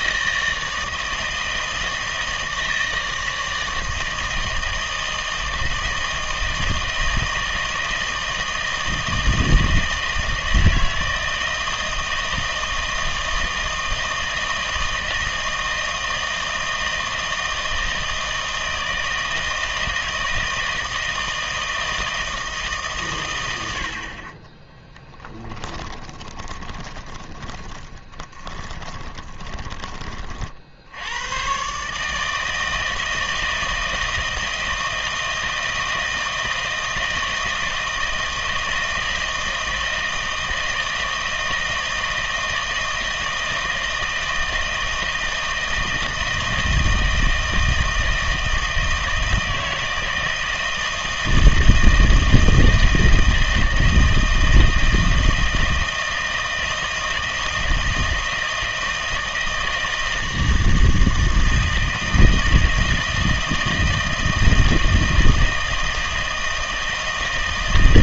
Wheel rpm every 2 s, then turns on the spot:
160, 160, 160, 160, 160, 160, 160, 160, 160, 160, 160, 150, 10, 20, 20, 60, 160, 160, 160, 160, 160, 160, 160, 160, 160, 160, 160, 160, 160, 160, 160, 160, 160, 160.
24-30